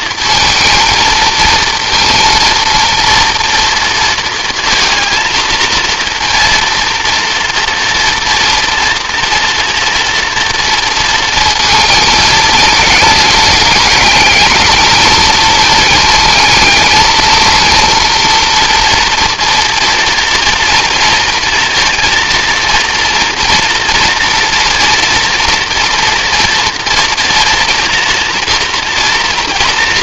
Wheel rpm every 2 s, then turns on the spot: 230, 230, 230, 230, 240, 230, 220, 220, 220, 240, 230, 230, 230, 240, 230.
none